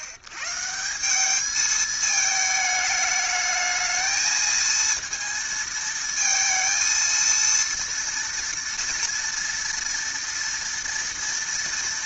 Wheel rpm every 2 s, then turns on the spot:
120, 210, 220, 230, 230, 230.
none